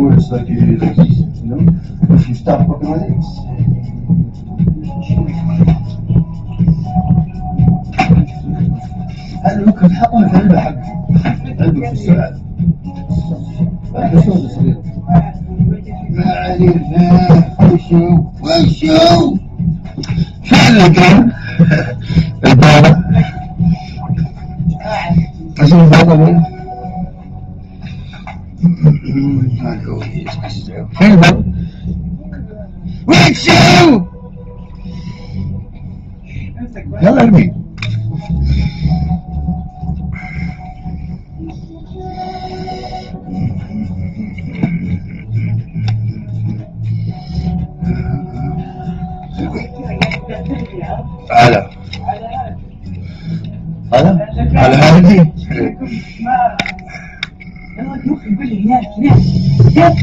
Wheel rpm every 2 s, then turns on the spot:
0, 0, 0, 0, 0, 0, 0, 0, 0, 0, 0, 0, 0, 0, 0, 0, 0, 0, 0, 0, 0, 0, 0, 0, 0, 0, 0, 0, 0, 0.
none